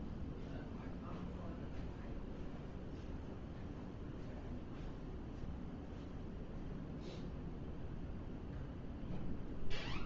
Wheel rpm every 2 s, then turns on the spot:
0, 0, 0, 0, 0.
none